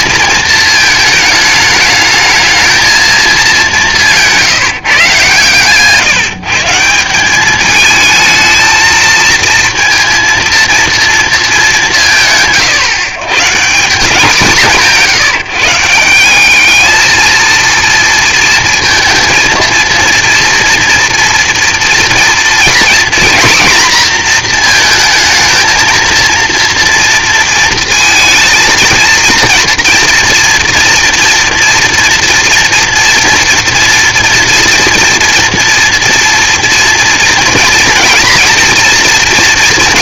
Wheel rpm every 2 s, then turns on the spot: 220, 220, 160, 160, 220, 230, 140, 180, 210, 230, 240, 240, 230, 230, 230, 230, 230, 230, 240, 230.
none